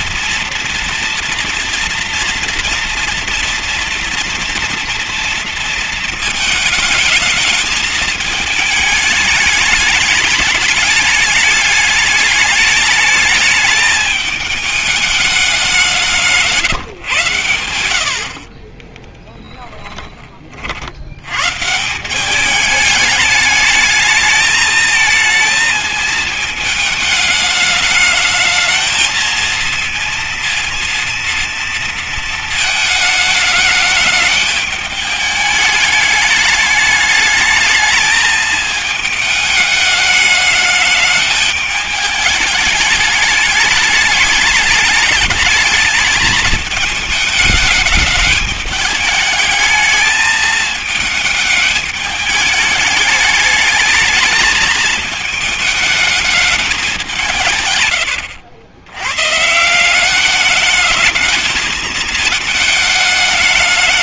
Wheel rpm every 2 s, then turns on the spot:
230, 230, 230, 230, 210, 210, 210, 210, 150, 40, 60, 200, 220, 220, 220, 230, 220, 210, 210, 220, 210, 210, 210, 220, 210, 220, 210, 220, 210, 90, 210, 220.
18-20